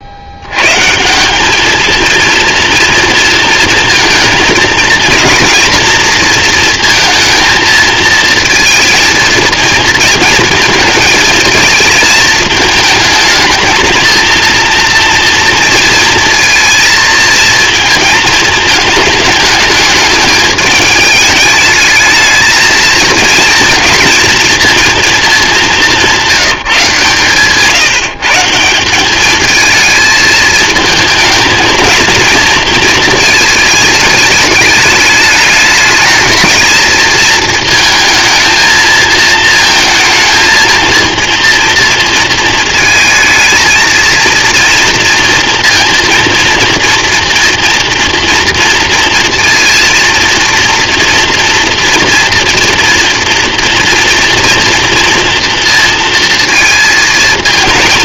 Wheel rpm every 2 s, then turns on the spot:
120, 230, 230, 230, 220, 230, 220, 230, 230, 220, 210, 220, 230, 160, 170, 220, 230, 210, 220, 230, 230, 220, 230, 230, 230, 240, 240, 240, 230.
none